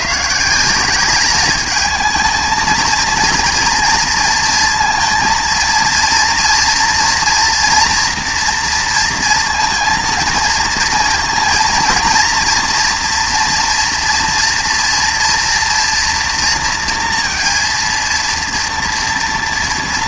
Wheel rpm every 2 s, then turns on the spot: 180, 220, 230, 230, 240, 230, 230, 240, 230, 230.
none